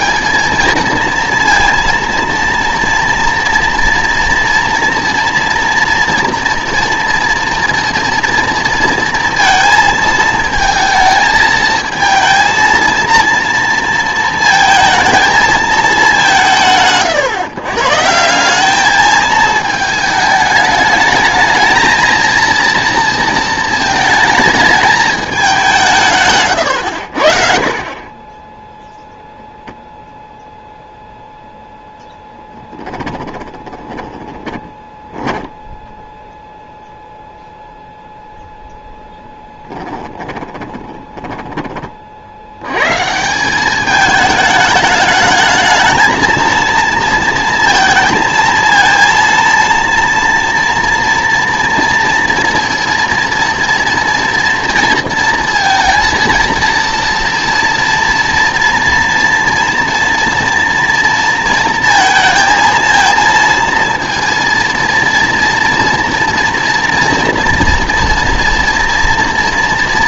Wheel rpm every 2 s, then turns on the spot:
220, 230, 240, 230, 230, 220, 230, 220, 160, 200, 210, 230, 220, 120, 10, 0, 10, 20, 0, 0, 20, 90, 210, 230, 230, 230, 230, 240, 230, 230, 230, 230, 230, 230, 230.
26-30 32-36 40-42